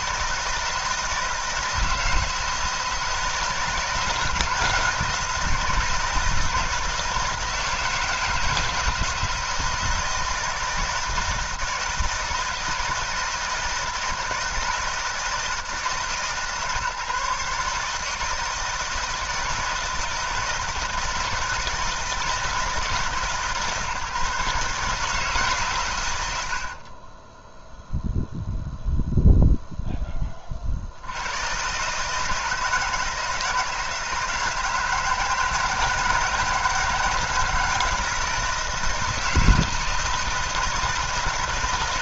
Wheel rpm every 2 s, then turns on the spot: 160, 160, 170, 160, 160, 160, 160, 160, 150, 160, 160, 150, 150, 30, 0, 70, 160, 160, 160, 160, 160.
26-28